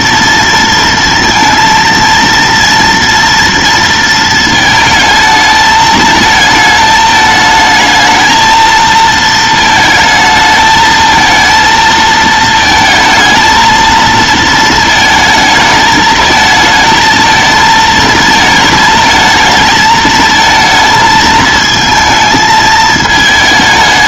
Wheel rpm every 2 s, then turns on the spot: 230, 230, 220, 220, 220, 220, 220, 220, 220, 220, 220, 220.
none